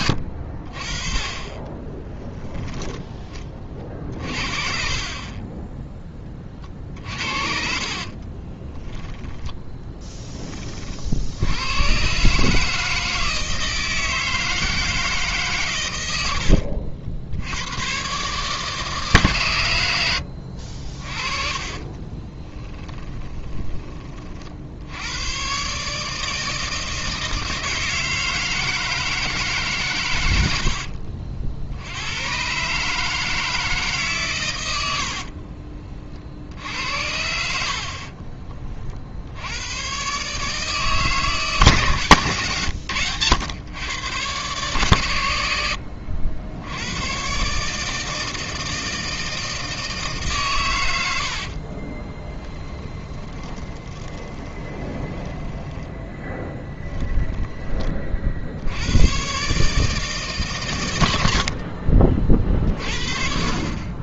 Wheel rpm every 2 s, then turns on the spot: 40, 10, 40, 40, 30, 20, 150, 160, 80, 150, 70, 20, 60, 160, 160, 90, 120, 120, 60, 40, 150, 120, 120, 90, 160, 130, 10, 20, 10, 70, 140, 50.
4-6 8-10 16-18 22-24 52-58